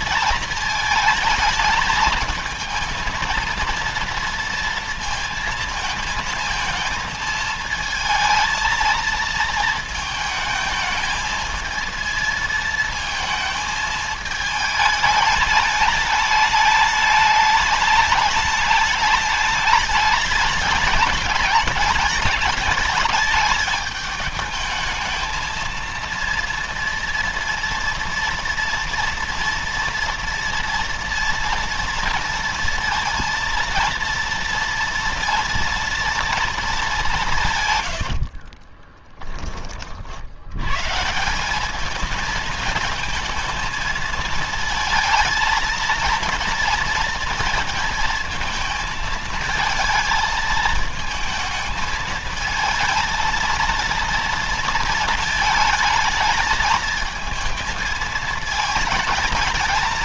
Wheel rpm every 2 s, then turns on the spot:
220, 230, 230, 220, 230, 220, 230, 210, 210, 210, 200, 220, 210, 230, 230, 230, 230, 240, 200, 20, 140, 220, 230, 230, 220, 220, 230, 230, 220, 220.
38-40